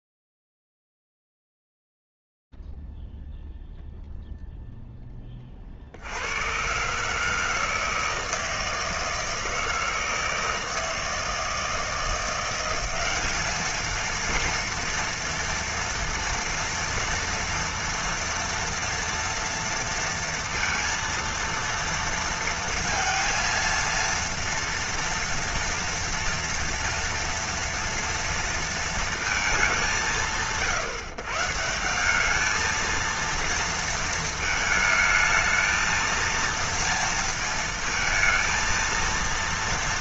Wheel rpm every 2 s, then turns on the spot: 0, 0, 0, 80, 160, 160, 170, 220, 230, 230, 230, 230, 230, 230, 230, 120, 220, 220, 230, 230.
none